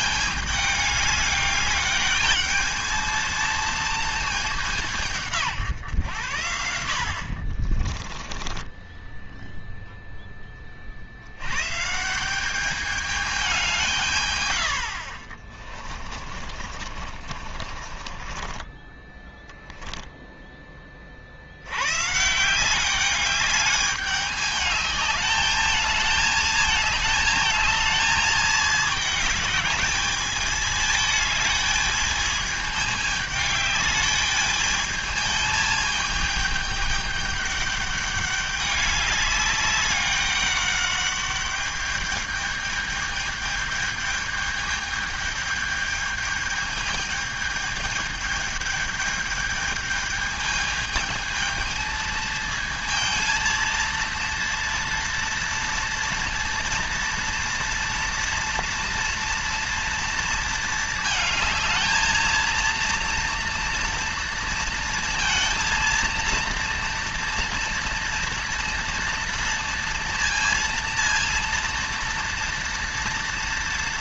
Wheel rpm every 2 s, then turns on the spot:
210, 220, 190, 80, 20, 40, 200, 90, 40, 20, 20, 180, 210, 220, 210, 220, 210, 210, 210, 200, 200, 210, 210, 220, 210, 220, 220, 230, 230, 230, 220, 230, 230, 230, 230, 230, 230.
8-10 16-20